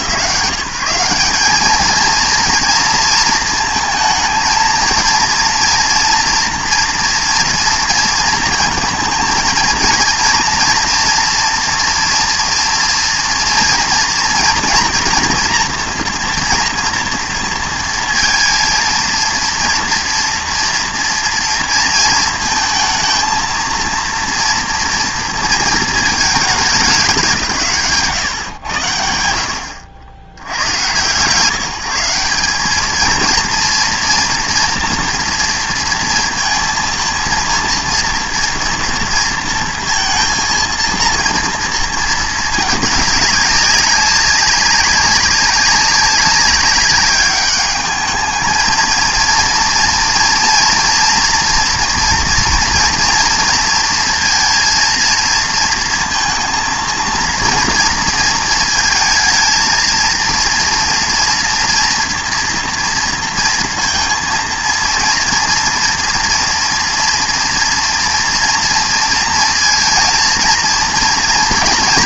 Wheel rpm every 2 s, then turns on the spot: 170, 230, 230, 230, 230, 230, 240, 230, 230, 230, 230, 220, 230, 200, 100, 110, 220, 230, 230, 230, 230, 210, 200, 190, 220, 230, 230, 230, 230, 230, 230, 230, 230, 240, 230, 230.
none